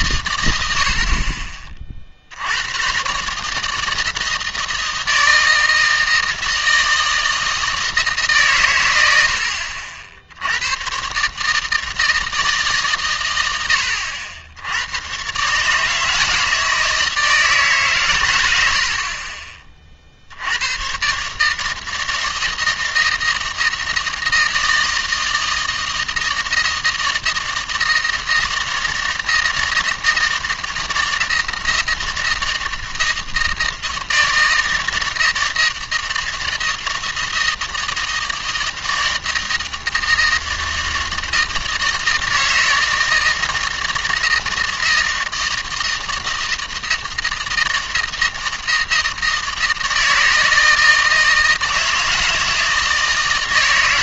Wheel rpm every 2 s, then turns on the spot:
70, 120, 160, 160, 120, 110, 140, 100, 160, 60, 110, 160, 160, 160, 160, 160, 160, 160, 160, 160, 160, 160, 160, 160, 160, 160, 160.
none